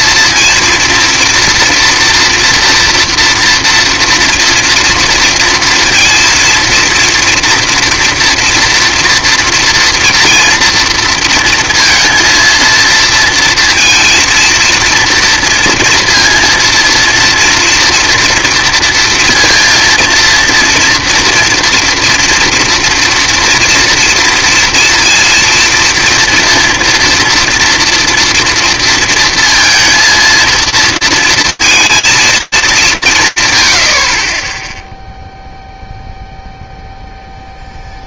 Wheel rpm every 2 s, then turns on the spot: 230, 240, 240, 230, 230, 230, 230, 230, 230, 230, 230, 230, 230, 230, 230, 230, 190, 0, 0.
none